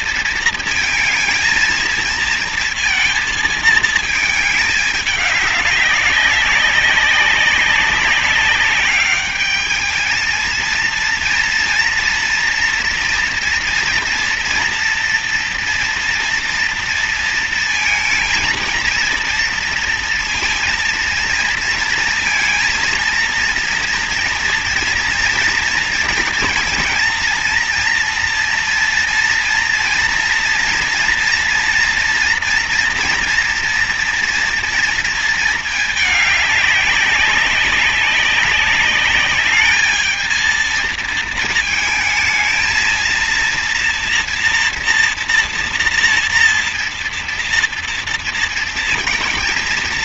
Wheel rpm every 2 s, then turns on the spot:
220, 230, 210, 200, 200, 230, 230, 230, 230, 230, 230, 230, 230, 230, 230, 230, 230, 230, 200, 200, 220, 220, 230, 230, 230.
none